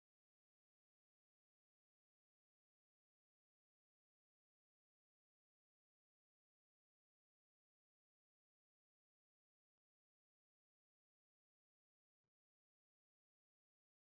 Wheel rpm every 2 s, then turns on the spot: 0, 0, 0, 0, 0, 0, 0.
none